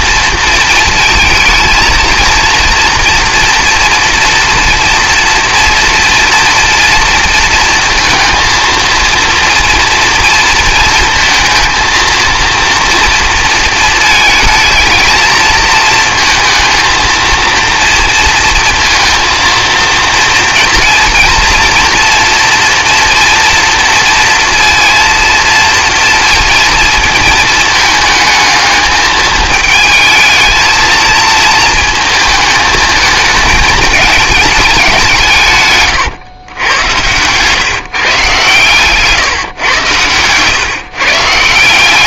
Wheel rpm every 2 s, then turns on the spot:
230, 240, 230, 230, 230, 230, 230, 230, 230, 230, 230, 230, 230, 220, 210, 220, 220, 190, 110, 150, 140.
none